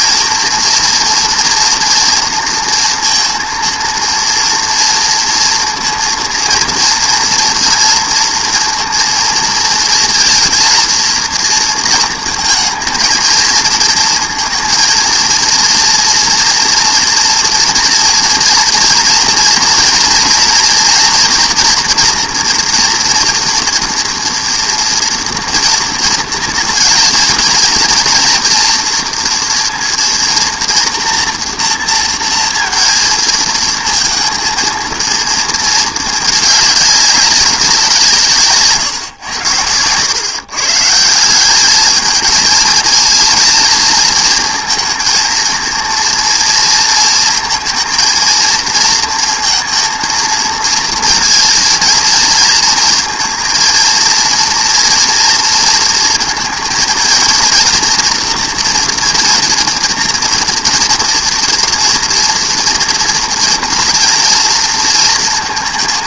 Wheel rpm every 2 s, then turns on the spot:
230, 230, 230, 230, 230, 230, 230, 230, 230, 230, 240, 230, 230, 220, 230, 230, 230, 230, 210, 150, 140, 220, 230, 230, 230, 230, 230, 230, 230, 230, 230, 230, 230.
none